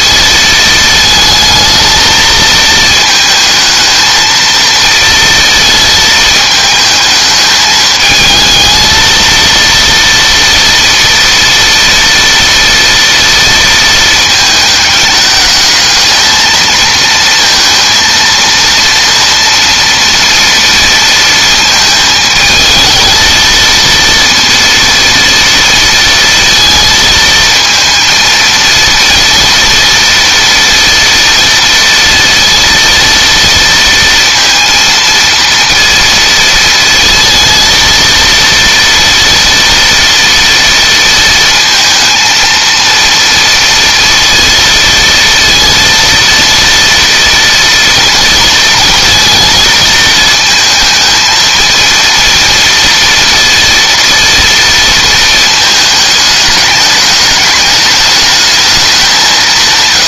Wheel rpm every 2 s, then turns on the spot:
220, 220, 230, 220, 220, 230, 230, 210, 220, 230, 230, 220, 230, 220, 230, 230, 230, 230, 230, 230, 230, 230, 230, 230, 230, 220, 230, 230, 210, 200.
none